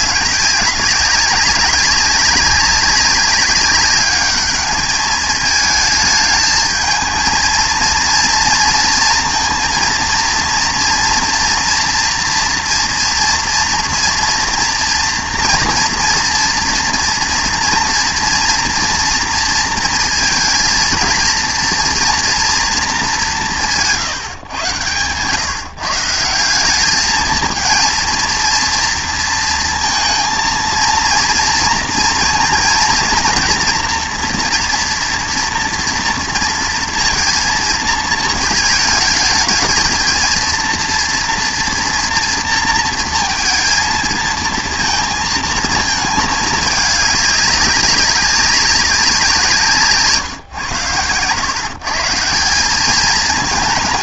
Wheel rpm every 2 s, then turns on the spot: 190, 200, 210, 220, 230, 230, 230, 230, 230, 230, 220, 240, 130, 180, 230, 230, 230, 240, 230, 220, 230, 230, 230, 210, 190, 120, 180.
none